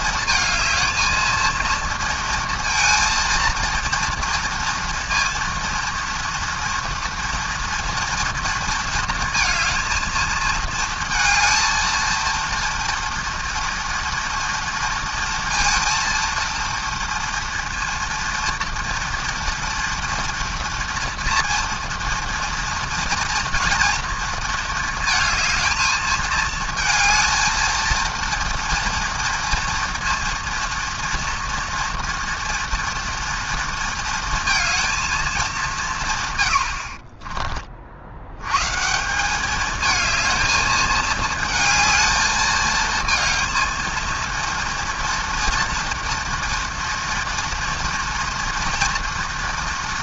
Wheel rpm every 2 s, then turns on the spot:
220, 230, 230, 230, 230, 220, 230, 230, 230, 230, 230, 230, 230, 220, 230, 230, 240, 230, 80, 150, 220, 220, 230, 230, 230.
none